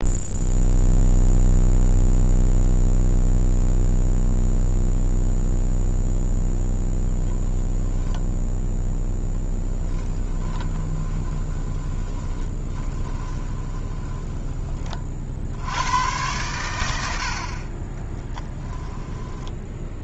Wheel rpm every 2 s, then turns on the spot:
0, 0, 0, 0, 0, 20, 20, 20, 90, 10.
10-14